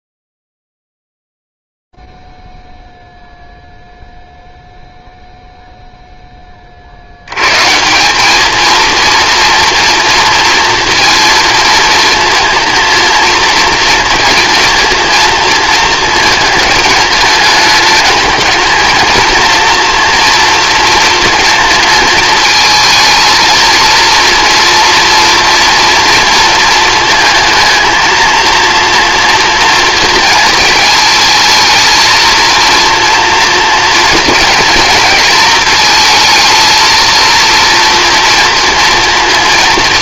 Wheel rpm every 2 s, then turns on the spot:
0, 0, 0, 10, 200, 230, 230, 230, 220, 220, 240, 230, 230, 230, 230, 230, 230, 230, 220, 230.
none